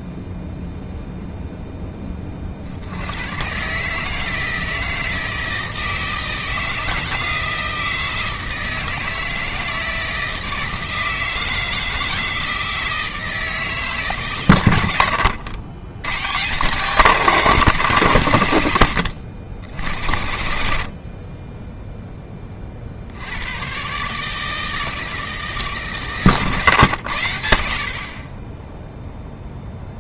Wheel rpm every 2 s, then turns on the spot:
0, 60, 160, 160, 160, 160, 160, 90, 180, 90, 50, 60, 160, 120, 20.
none